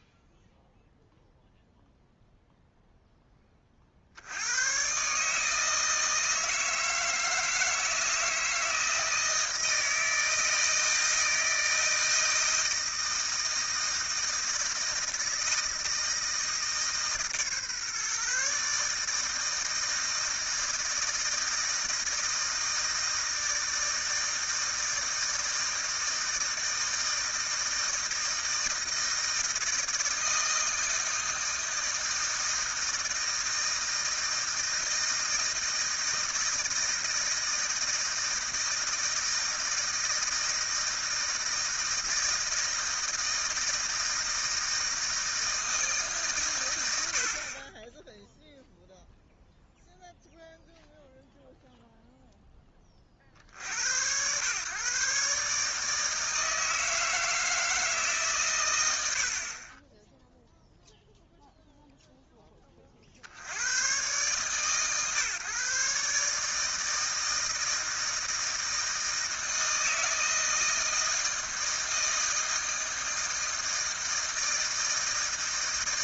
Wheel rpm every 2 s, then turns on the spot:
0, 0, 120, 160, 160, 160, 160, 160, 160, 150, 160, 160, 160, 160, 160, 160, 160, 160, 160, 160, 160, 160, 160, 110, 0, 0, 0, 120, 160, 120, 0, 20, 130, 150, 160, 160, 160, 160.
none